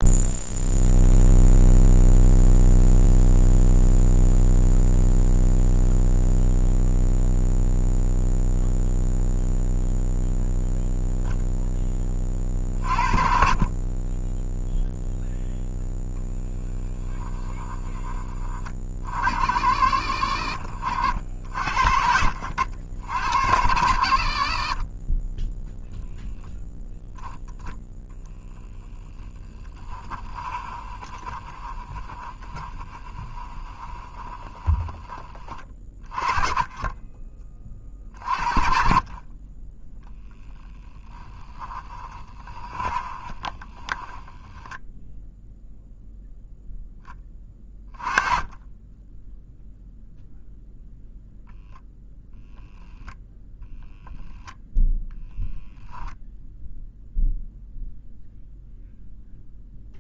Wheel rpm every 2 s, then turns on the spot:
0, 0, 0, 0, 0, 0, 40, 0, 10, 40, 60, 80, 20, 0, 10, 20, 20, 20, 20, 40, 10, 20, 10, 10, 10, 0, 0, 0, 0, 0.
28-34 42-44